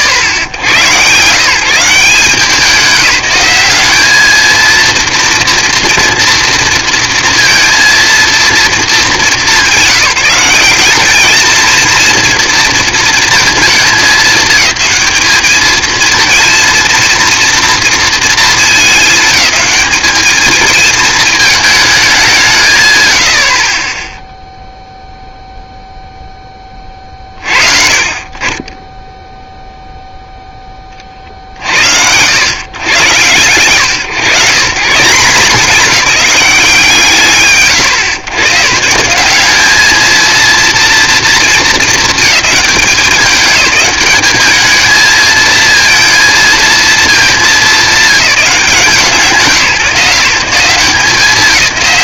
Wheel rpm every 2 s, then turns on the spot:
90, 180, 230, 230, 230, 200, 230, 220, 230, 220, 220, 160, 0, 10, 30, 0, 110, 160, 170, 150, 230, 210, 220, 220, 170, 170.
none